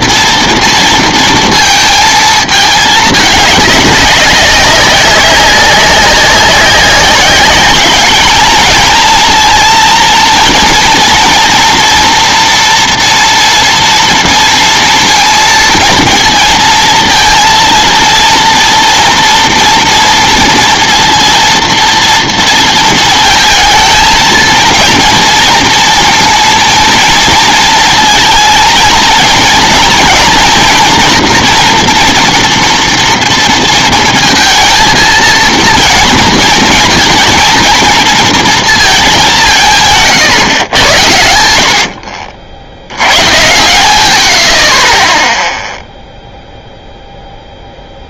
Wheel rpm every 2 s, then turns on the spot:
230, 220, 190, 190, 220, 230, 230, 230, 230, 230, 230, 230, 230, 230, 220, 240, 230, 230, 230, 230, 120, 70, 40, 0.
none